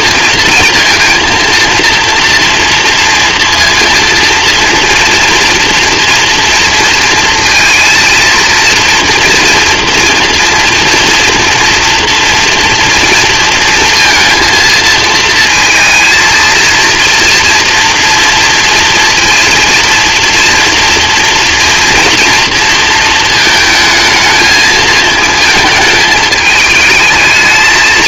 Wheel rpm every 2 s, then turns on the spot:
230, 230, 230, 230, 230, 230, 230, 230, 230, 230, 230, 230, 220, 210.
none